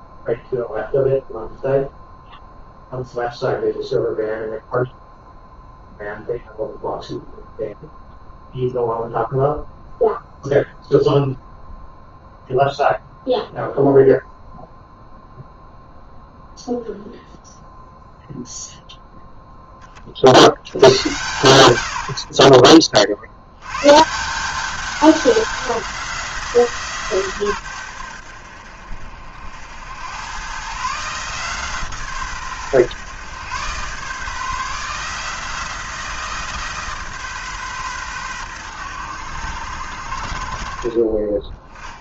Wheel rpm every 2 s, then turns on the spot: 0, 0, 0, 0, 0, 0, 0, 0, 0, 0, 80, 40, 190, 160, 60, 130, 130, 150, 150, 110, 50.
none